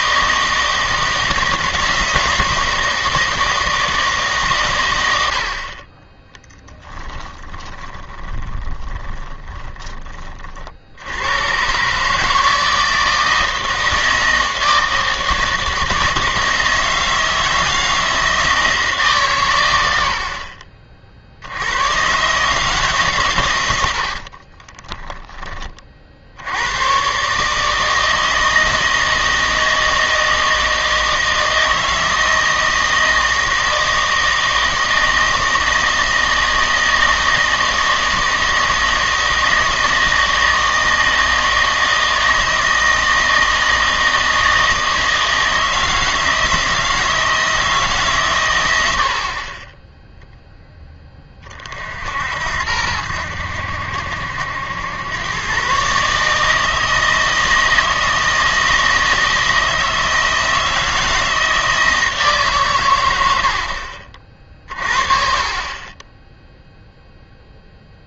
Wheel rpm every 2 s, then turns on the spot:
160, 160, 120, 10, 20, 60, 160, 160, 160, 160, 40, 150, 20, 100, 160, 160, 160, 160, 160, 160, 160, 160, 160, 160, 90, 10, 70, 90, 160, 160, 160, 130, 50, 0.
6-10 24-26